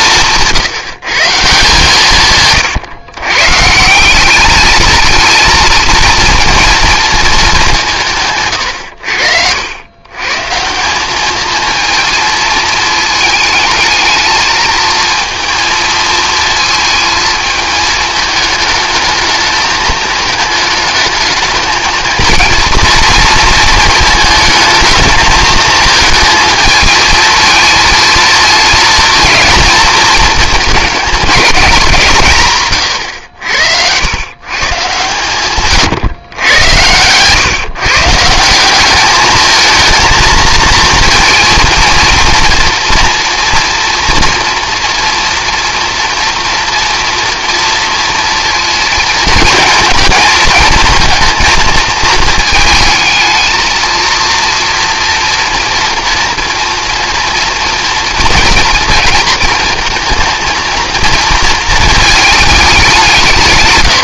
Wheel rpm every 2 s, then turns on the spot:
170, 150, 220, 230, 120, 170, 230, 230, 220, 220, 220, 230, 220, 220, 220, 220, 130, 120, 110, 190, 230, 230, 230, 230, 230, 220, 220, 230, 230, 230, 230, 200.
36-38